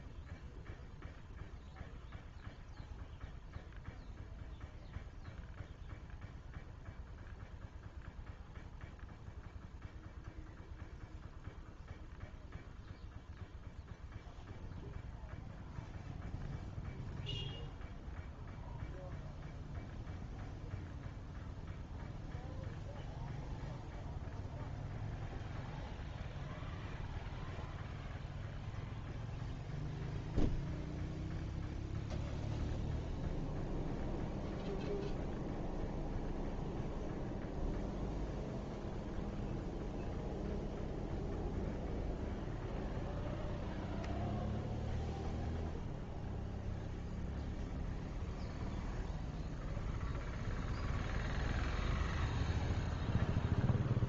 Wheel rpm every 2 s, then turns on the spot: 0, 0, 0, 0, 0, 0, 0, 0, 0, 0, 0, 0, 0, 0, 0, 0, 0, 0, 0, 0, 0, 0, 0, 0, 0, 0, 0.
none